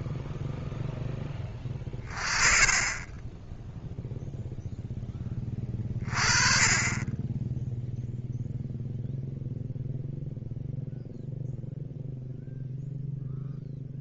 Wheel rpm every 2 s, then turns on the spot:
0, 20, 0, 20, 0, 0, 0.
none